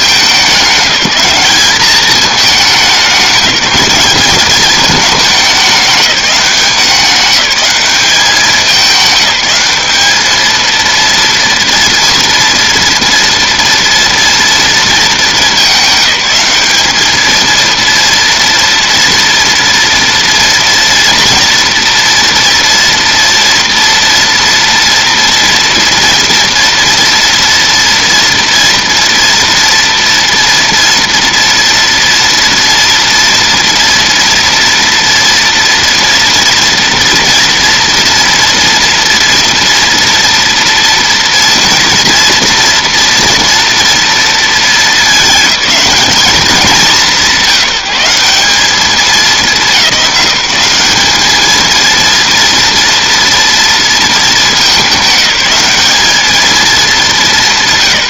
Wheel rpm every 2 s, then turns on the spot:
190, 200, 200, 190, 200, 220, 240, 230, 200, 230, 230, 230, 230, 230, 230, 230, 230, 230, 230, 230, 230, 240, 220, 210, 200, 200, 230, 220, 210.
none